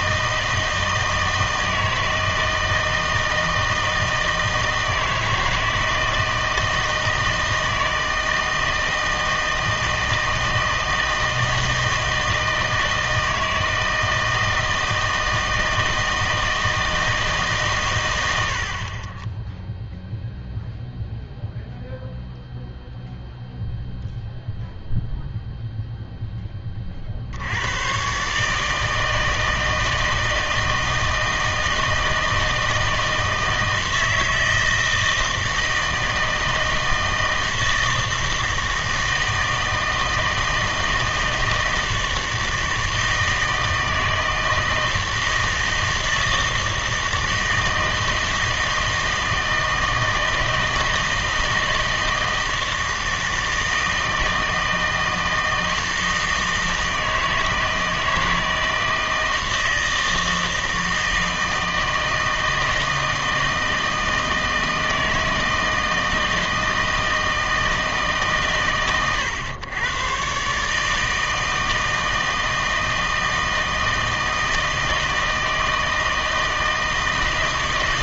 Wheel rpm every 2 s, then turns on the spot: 160, 160, 160, 160, 160, 160, 160, 160, 160, 60, 0, 0, 0, 20, 150, 160, 160, 160, 160, 160, 160, 160, 160, 160, 160, 160, 160, 160, 160, 160, 160, 160, 160, 160, 120, 150, 160, 160, 160.
none